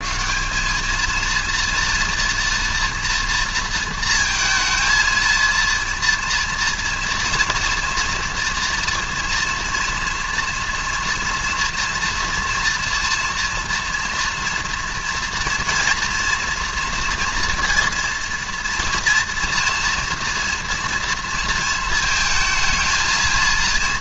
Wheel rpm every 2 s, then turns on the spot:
200, 230, 230, 230, 240, 230, 230, 230, 240, 230, 240, 220.
none